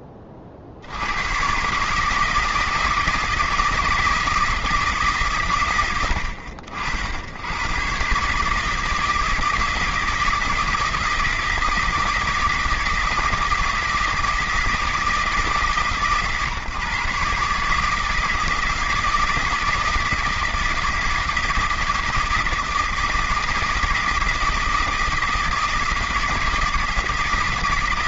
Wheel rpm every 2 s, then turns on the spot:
90, 160, 160, 80, 160, 160, 160, 160, 140, 160, 160, 160, 160, 160.
none